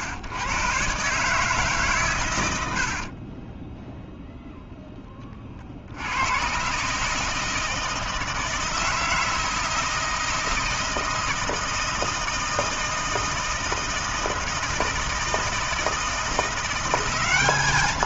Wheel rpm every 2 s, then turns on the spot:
120, 110, 0, 100, 160, 160, 160, 160, 170.
2-4